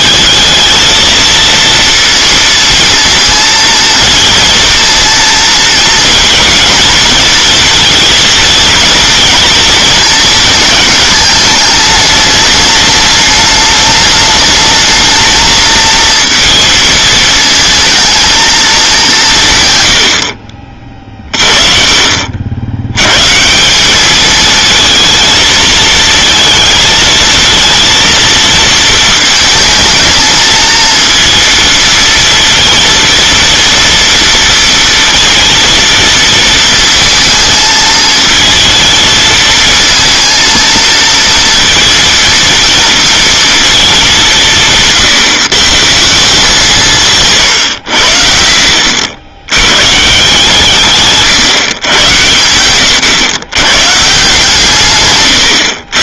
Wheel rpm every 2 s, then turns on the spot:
220, 230, 230, 230, 230, 220, 210, 220, 230, 210, 50, 90, 230, 220, 220, 230, 230, 230, 230, 220, 230, 230, 160, 170, 70, 150, 120, 150.
none